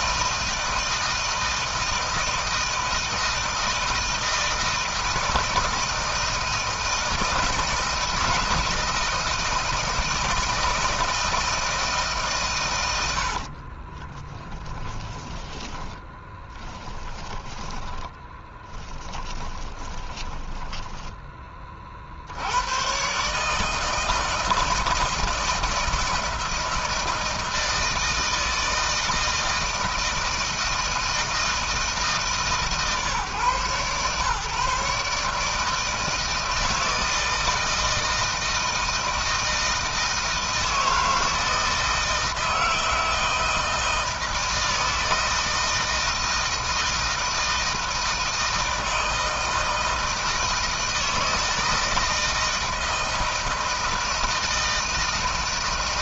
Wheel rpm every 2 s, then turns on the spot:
160, 160, 160, 160, 160, 160, 100, 20, 10, 20, 10, 120, 160, 160, 160, 160, 150, 150, 160, 160, 160, 160, 160, 160, 160, 160, 160, 160.
12-22